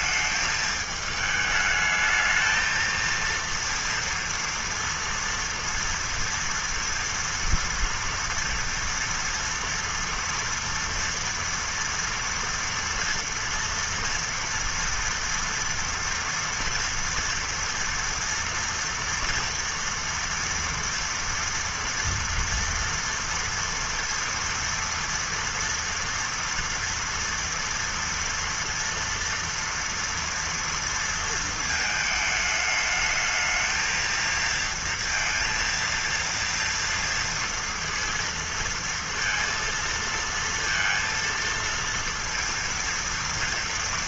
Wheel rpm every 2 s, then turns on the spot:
220, 220, 230, 230, 240, 240, 230, 230, 230, 230, 230, 230, 230, 230, 230, 230, 220, 230, 230, 230, 230, 230.
none